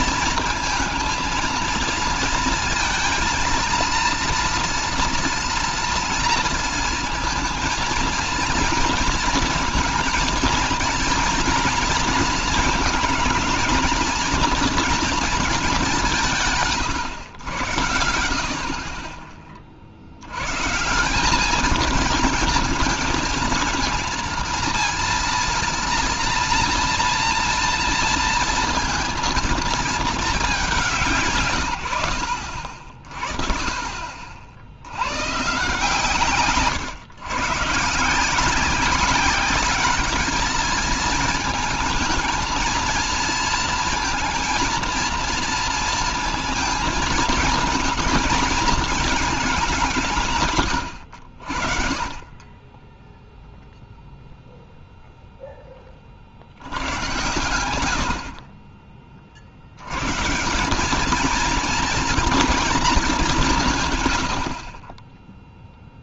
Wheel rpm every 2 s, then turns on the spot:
230, 230, 230, 230, 230, 230, 220, 230, 140, 50, 150, 220, 230, 230, 230, 190, 60, 80, 120, 180, 220, 230, 230, 220, 220, 110, 20, 0, 90, 30, 190, 220, 30.
none